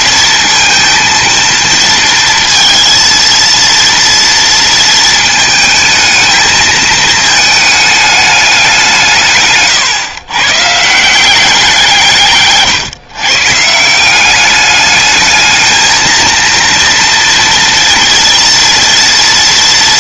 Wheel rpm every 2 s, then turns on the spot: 230, 230, 220, 220, 160, 170, 130, 210, 230, 230.
none